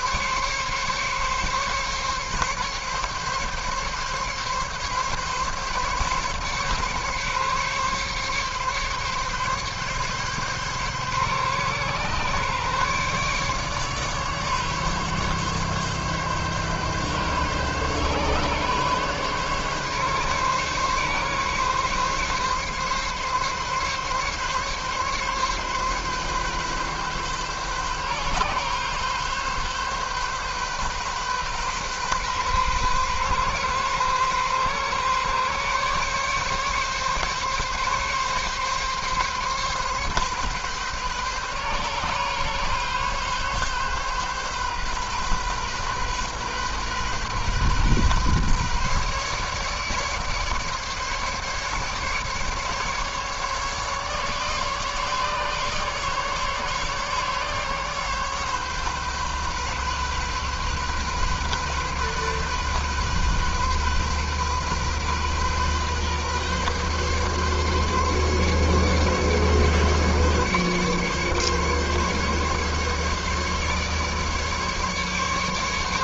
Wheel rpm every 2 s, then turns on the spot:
140, 140, 140, 140, 140, 140, 140, 140, 140, 140, 140, 140, 140, 130, 130, 130, 130, 130, 140, 140, 130, 130, 130, 130, 140, 150, 140, 150, 140, 140, 130, 130, 130, 140, 140, 140, 140, 140.
none